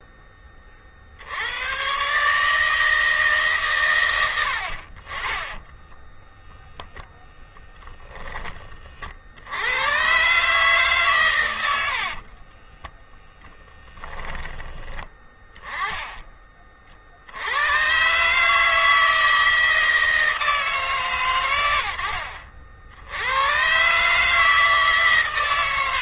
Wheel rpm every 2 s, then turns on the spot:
50, 150, 50, 0, 30, 120, 10, 20, 60, 160, 140, 80, 140.
12-14